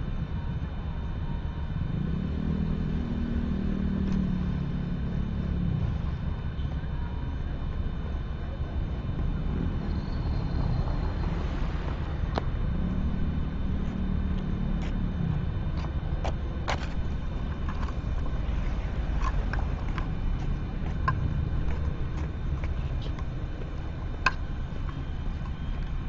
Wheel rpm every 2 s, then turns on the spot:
0, 0, 0, 0, 0, 0, 0, 0, 0, 0, 0, 0, 0.
none